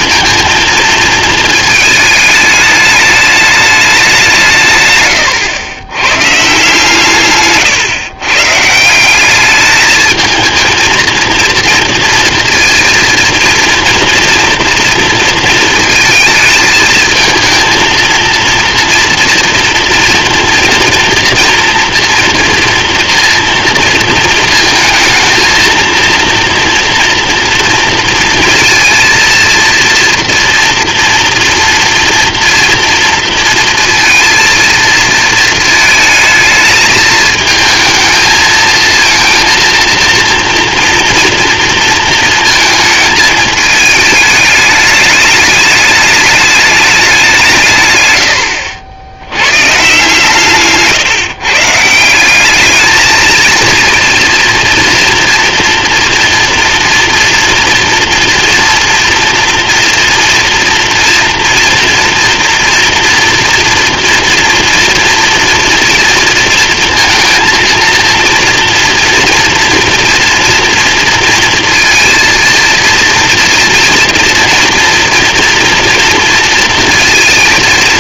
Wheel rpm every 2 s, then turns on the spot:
230, 210, 120, 140, 190, 230, 230, 230, 220, 230, 230, 230, 230, 230, 230, 230, 230, 230, 220, 230, 240, 220, 210, 180, 80, 150, 220, 240, 240, 230, 230, 230, 240, 230, 230, 230, 230, 230, 230.
6-8